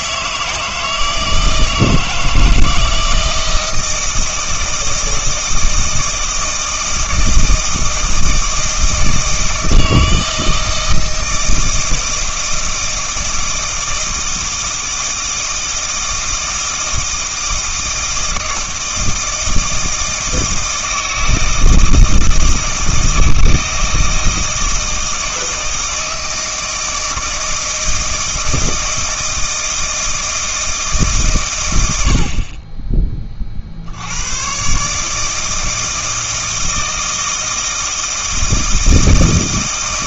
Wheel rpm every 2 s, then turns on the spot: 160, 160, 160, 160, 160, 160, 160, 160, 160, 160, 160, 160, 160, 160, 160, 160, 30, 140, 160, 160.
none